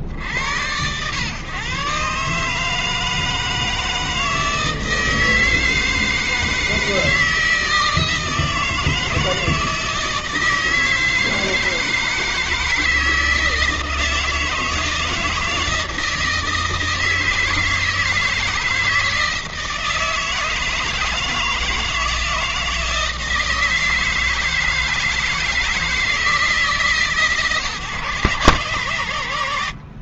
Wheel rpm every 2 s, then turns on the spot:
70, 150, 160, 160, 160, 160, 160, 160, 160, 160, 160, 160, 160, 150, 120.
none